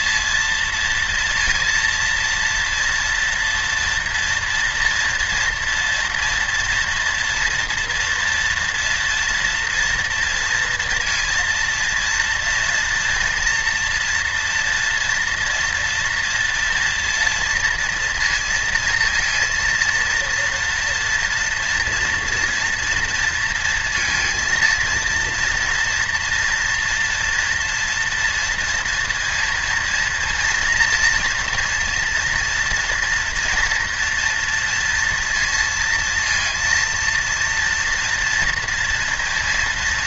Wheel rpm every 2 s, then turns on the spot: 230, 230, 230, 240, 230, 230, 230, 230, 230, 230, 230, 230, 230, 230, 230, 230, 240, 230, 230, 230.
none